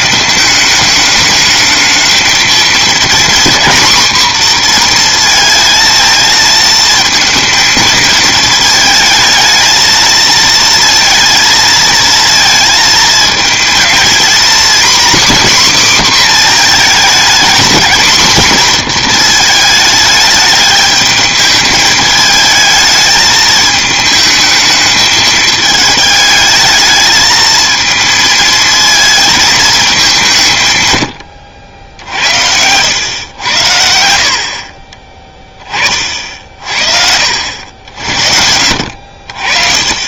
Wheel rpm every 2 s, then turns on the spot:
210, 230, 240, 220, 220, 230, 230, 250, 240, 240, 210, 220, 220, 220, 220, 140, 100, 40, 50, 70.
none